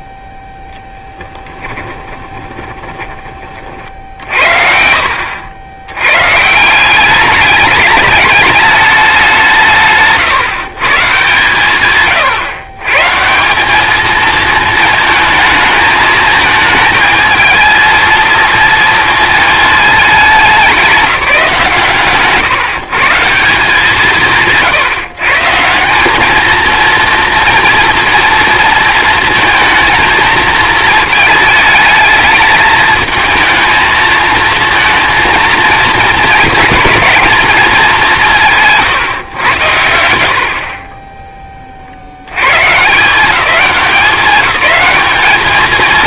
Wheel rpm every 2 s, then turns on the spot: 0, 20, 60, 160, 210, 140, 140, 220, 220, 230, 190, 140, 150, 220, 230, 230, 220, 230, 230, 150, 50, 130, 210.
2-4